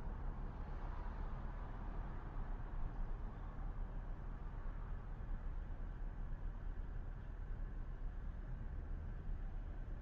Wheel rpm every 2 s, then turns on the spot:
0, 0, 0, 0, 0.
none